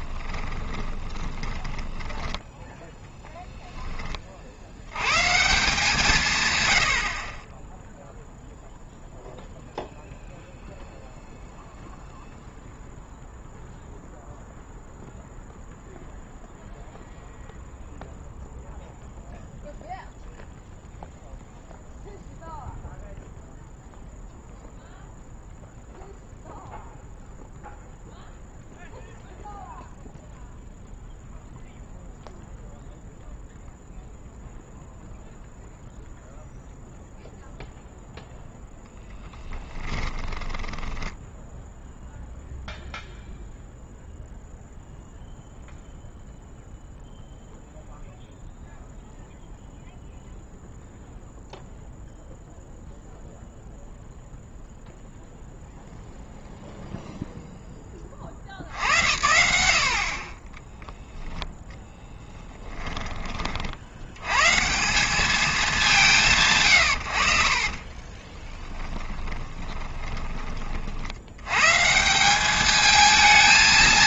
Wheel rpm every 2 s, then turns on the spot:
20, 0, 80, 90, 0, 0, 0, 0, 0, 0, 0, 0, 0, 0, 0, 0, 0, 0, 0, 0, 10, 0, 0, 0, 0, 0, 0, 0, 0, 70, 10, 20, 160, 140, 10, 40, 210.
0-2 40-42 62-64 68-70